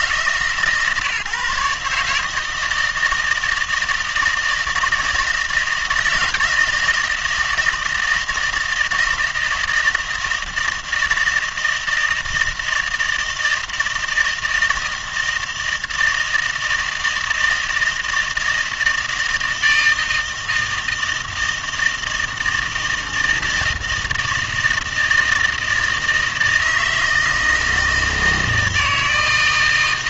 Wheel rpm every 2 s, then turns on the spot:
140, 160, 160, 160, 160, 160, 160, 160, 160, 160, 160, 160, 160, 160, 160.
none